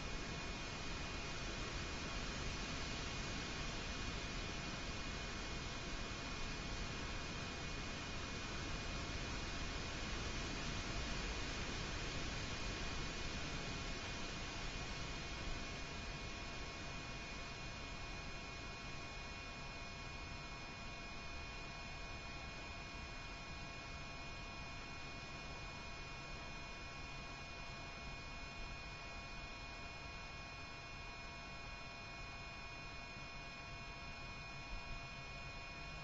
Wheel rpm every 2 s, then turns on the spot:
0, 0, 0, 0, 0, 0, 0, 0, 0, 0, 0, 0, 0, 0, 0, 0, 0, 0.
none